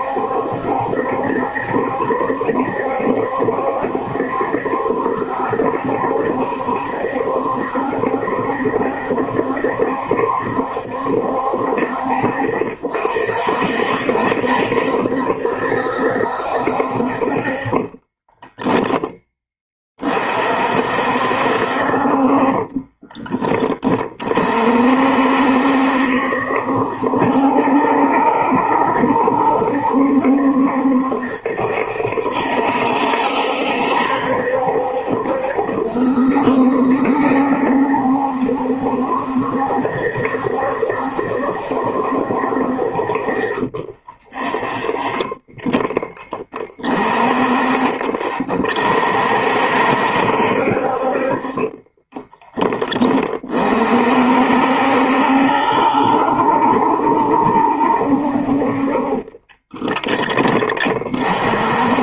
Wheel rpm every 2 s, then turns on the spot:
70, 70, 70, 70, 70, 70, 60, 70, 60, 20, 50, 30, 50, 70, 70, 70, 70, 70, 70, 70, 70, 60, 10, 20, 50, 60, 10, 60, 70, 50, 20.
18-20 22-24